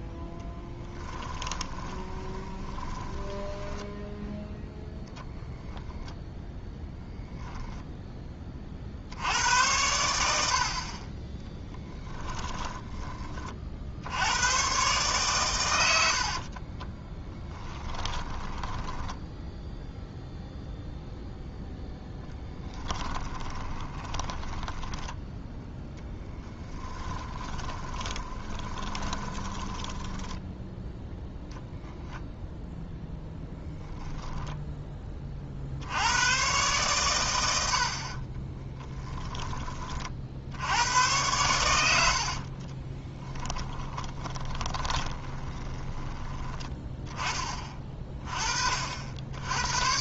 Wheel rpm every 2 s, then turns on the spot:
10, 10, 10, 0, 30, 60, 10, 120, 30, 10, 0, 20, 10, 10, 20, 10, 0, 10, 120, 20, 80, 40, 20, 10, 40.
0-4 16-20 22-30 38-40 42-46